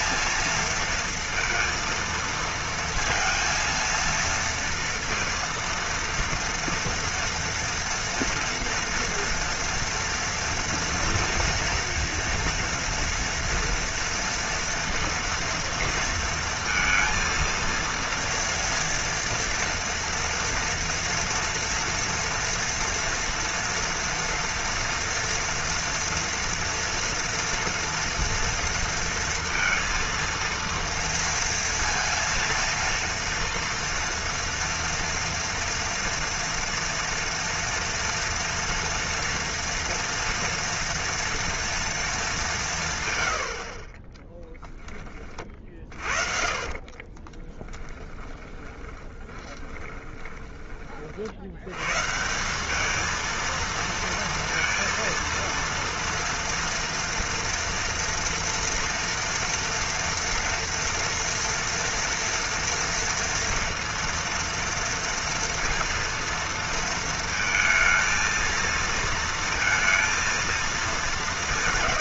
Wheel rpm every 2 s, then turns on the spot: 230, 230, 230, 230, 230, 230, 230, 230, 230, 230, 230, 240, 240, 230, 230, 230, 230, 230, 230, 230, 230, 160, 10, 30, 20, 20, 190, 230, 230, 230, 240, 230, 230, 230, 230, 210.
46-50